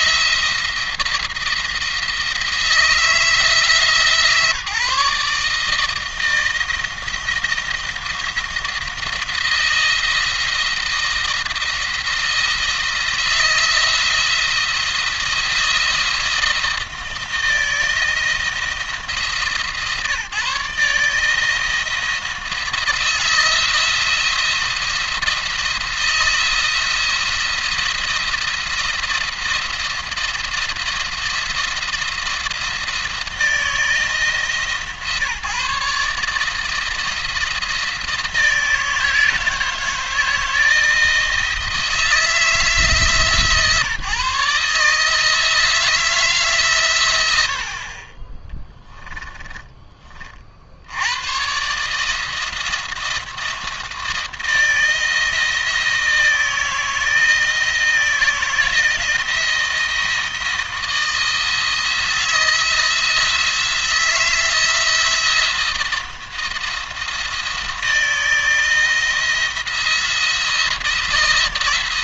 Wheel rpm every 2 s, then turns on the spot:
170, 160, 140, 160, 170, 170, 170, 170, 170, 170, 160, 170, 170, 170, 170, 170, 170, 160, 160, 160, 160, 160, 150, 120, 10, 70, 170, 160, 160, 160, 160, 170, 170, 170, 170, 170.
48-50